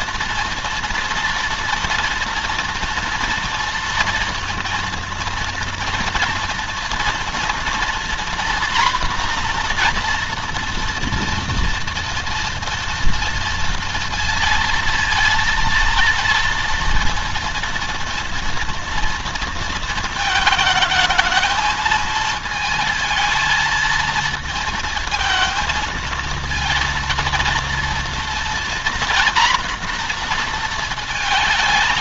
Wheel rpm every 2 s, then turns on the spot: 230, 240, 230, 230, 240, 240, 230, 230, 230, 230, 220, 220, 230, 230, 240, 230.
none